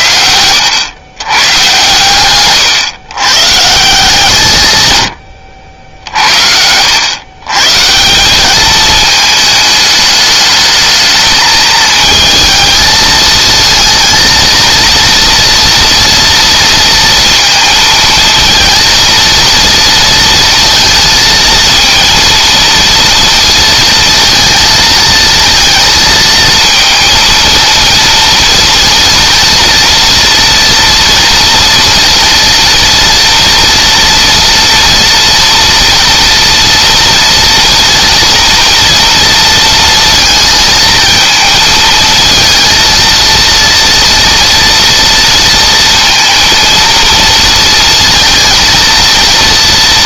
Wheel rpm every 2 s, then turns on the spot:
110, 120, 90, 120, 220, 220, 220, 230, 230, 230, 230, 230, 230, 230, 230, 230, 230, 230, 230, 230, 230, 230, 230, 230, 230.
4-6